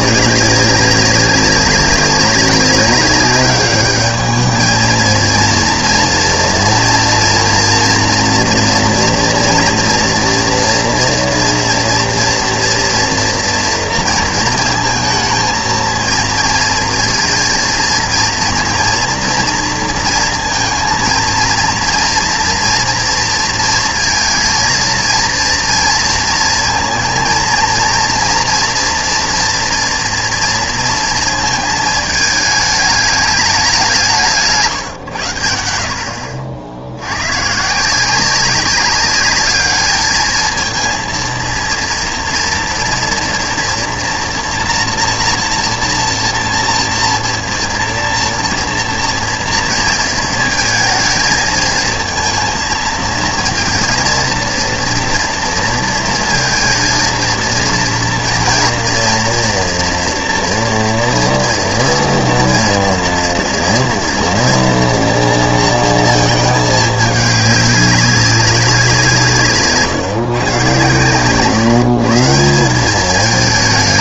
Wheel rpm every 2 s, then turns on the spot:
200, 200, 220, 230, 230, 230, 230, 230, 230, 240, 230, 230, 230, 230, 230, 230, 210, 140, 80, 200, 230, 230, 240, 230, 230, 230, 230, 230, 230, 230, 230, 230, 230, 210, 190, 130, 190.
none